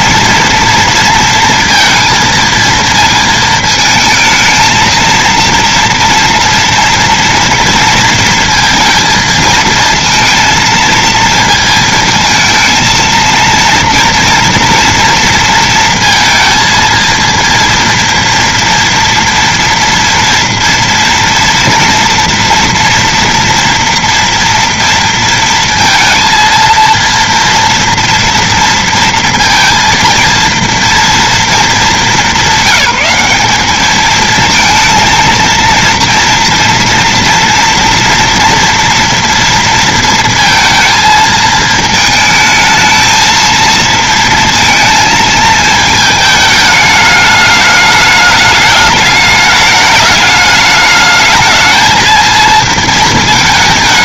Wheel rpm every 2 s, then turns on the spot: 230, 230, 220, 230, 230, 230, 220, 240, 230, 240, 230, 230, 230, 230, 230, 230, 210, 210, 230, 240, 230, 220, 230, 210, 210, 210, 220.
none